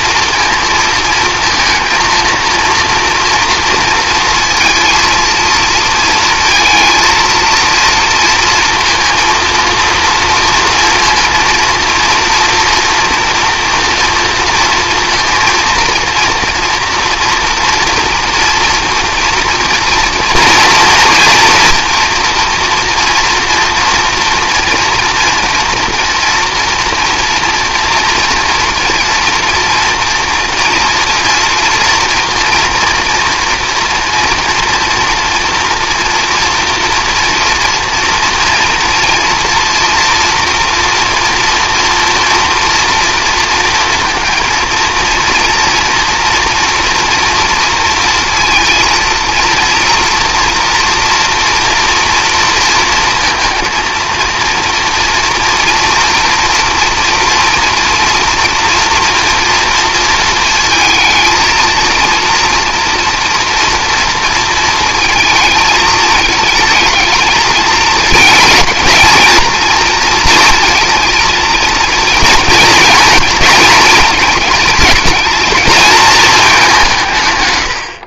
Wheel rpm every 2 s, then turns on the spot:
220, 230, 230, 230, 230, 230, 230, 230, 240, 230, 230, 240, 230, 230, 230, 230, 230, 240, 230, 240, 230, 230, 230, 230, 230, 240, 230, 230, 230, 230, 220, 230, 230, 220, 220, 230, 230, 220, 190.
none